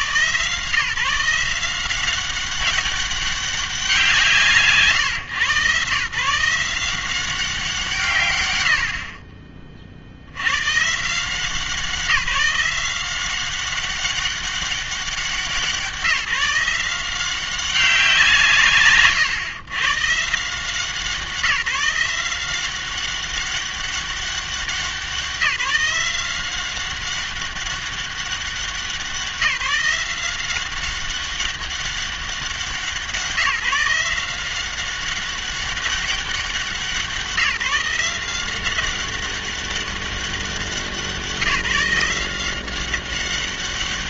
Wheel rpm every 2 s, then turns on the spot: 140, 200, 140, 170, 60, 120, 180, 190, 170, 140, 170, 180, 190, 190, 190, 190, 180, 180, 190, 190, 180, 180.
none